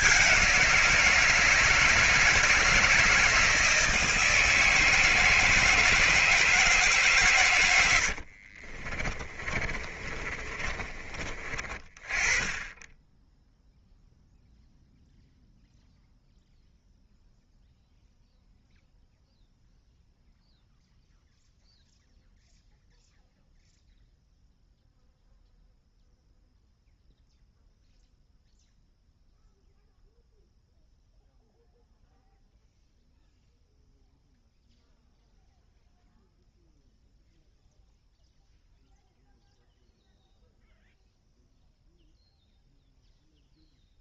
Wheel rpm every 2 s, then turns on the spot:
180, 160, 160, 160, 40, 30, 30, 0, 0, 0, 0, 0, 0, 0, 0, 0, 0, 0, 0, 0, 0, 0.
8-12